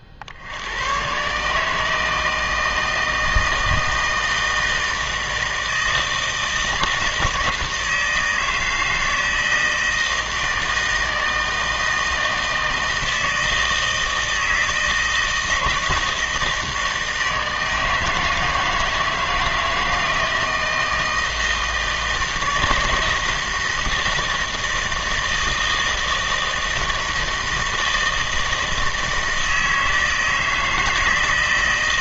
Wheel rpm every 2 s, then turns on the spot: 90, 160, 160, 160, 160, 160, 160, 160, 160, 160, 160, 160, 160, 160, 160, 160.
none